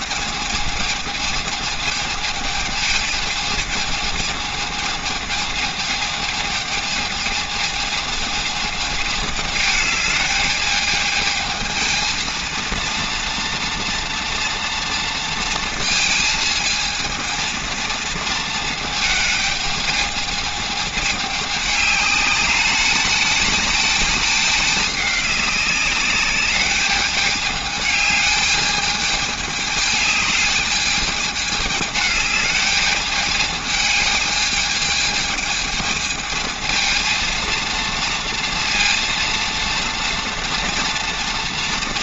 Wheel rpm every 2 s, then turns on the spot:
220, 220, 220, 220, 220, 210, 230, 230, 220, 230, 220, 210, 210, 200, 210, 210, 210, 220, 220, 230, 230.
none